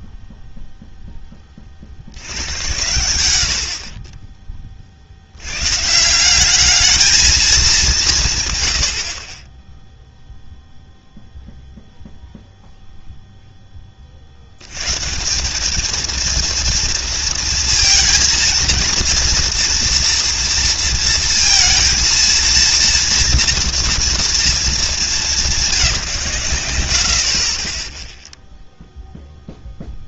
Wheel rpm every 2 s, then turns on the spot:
0, 90, 60, 210, 60, 0, 0, 120, 230, 230, 230, 230, 220, 70, 0.
none